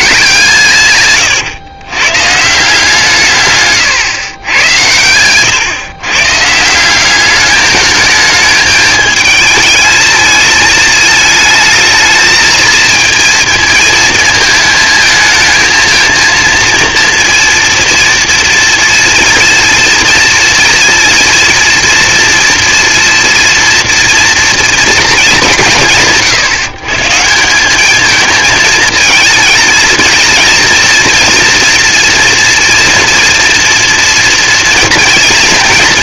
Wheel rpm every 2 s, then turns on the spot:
140, 160, 110, 170, 220, 210, 220, 220, 230, 230, 230, 230, 240, 140, 220, 230, 230, 230.
none